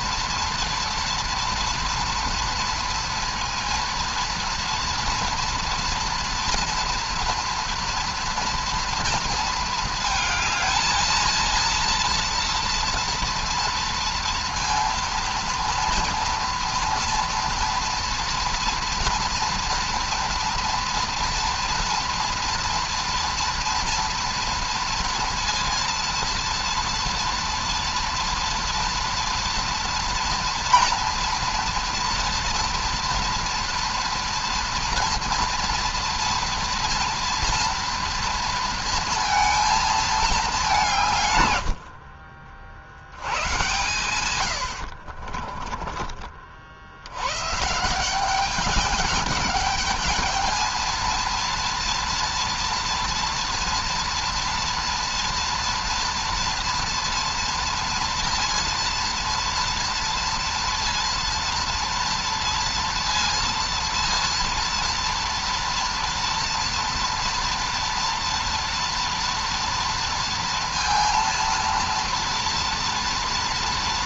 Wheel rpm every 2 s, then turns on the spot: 230, 230, 230, 230, 230, 220, 230, 230, 230, 230, 230, 230, 230, 240, 230, 230, 230, 230, 230, 230, 180, 60, 60, 70, 210, 220, 240, 240, 230, 230, 230, 230, 230, 230, 230, 230, 240.
44-46